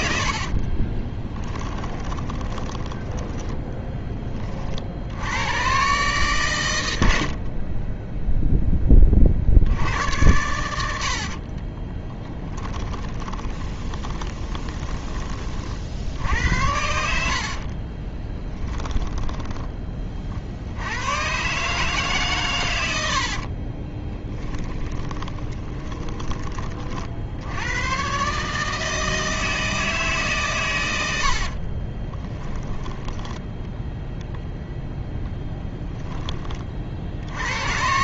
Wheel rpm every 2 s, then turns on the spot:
30, 10, 60, 90, 20, 90, 20, 20, 70, 10, 80, 90, 10, 40, 160, 100, 10, 10, 50.
0-4 10-14 24-26